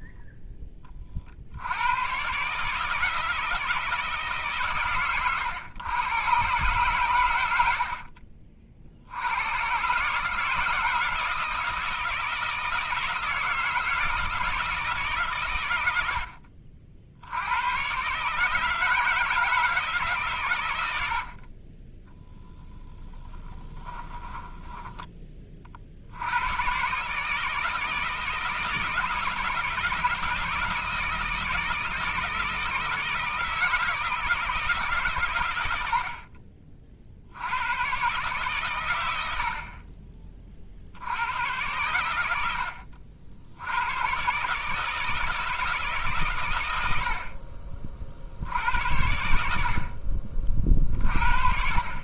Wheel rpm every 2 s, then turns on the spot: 20, 150, 130, 120, 50, 160, 160, 160, 70, 160, 90, 10, 10, 130, 170, 160, 160, 150, 40, 110, 70, 70, 150, 80, 90, 40.
none